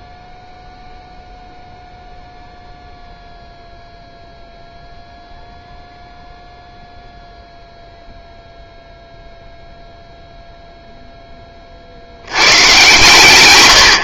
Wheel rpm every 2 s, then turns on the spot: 0, 0, 0, 0, 0, 0, 110.
none